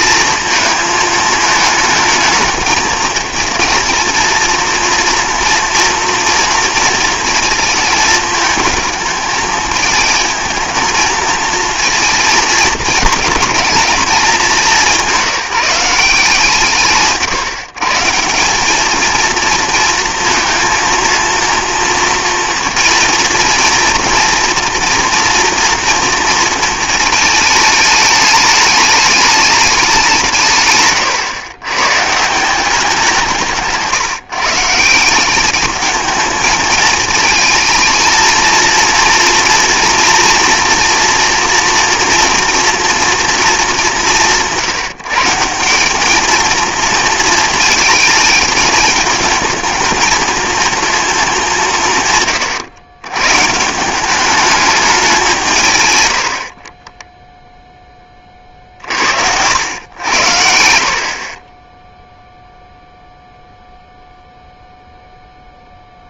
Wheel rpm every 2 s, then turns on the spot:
220, 220, 230, 230, 220, 220, 220, 200, 160, 200, 230, 230, 230, 230, 210, 140, 180, 160, 220, 230, 230, 240, 160, 230, 220, 230, 120, 210, 40, 50, 60, 0, 0.
56-58